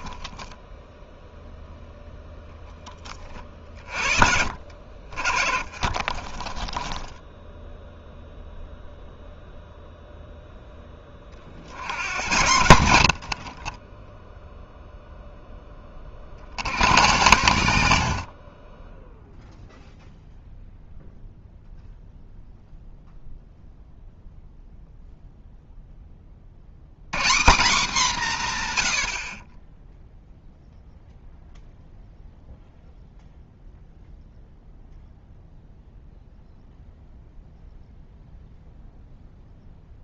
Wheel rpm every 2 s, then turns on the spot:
10, 20, 60, 10, 0, 10, 90, 0, 80, 30, 0, 0, 0, 100, 120, 0, 0, 0, 0, 0.
0-2 4-8